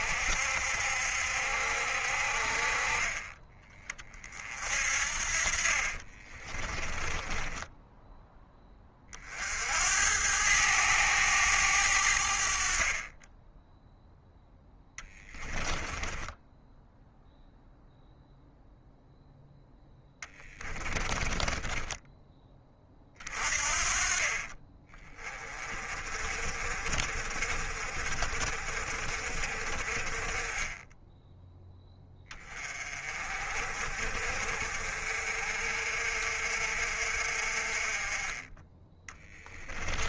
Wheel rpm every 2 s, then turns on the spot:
70, 40, 50, 20, 20, 100, 30, 10, 0, 0, 20, 30, 30, 50, 40, 10, 30, 50, 50, 20.
6-8 14-16 20-22 30-32